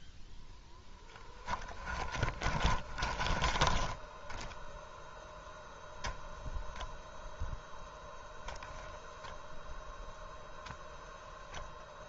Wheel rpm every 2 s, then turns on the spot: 0, 20, 0, 0, 0, 0.
2-4